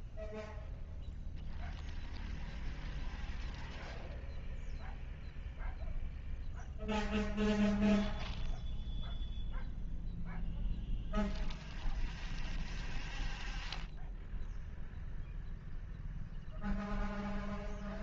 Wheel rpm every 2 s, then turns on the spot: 0, 0, 0, 0, 0, 0, 0, 0, 0.
none